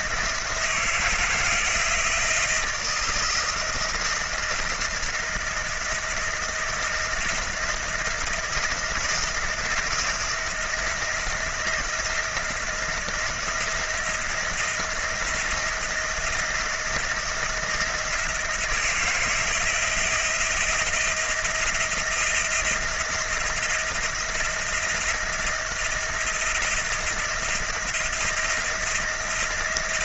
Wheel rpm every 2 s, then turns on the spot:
170, 160, 170, 170, 170, 170, 170, 170, 160, 160, 170, 170, 170, 160, 170.
none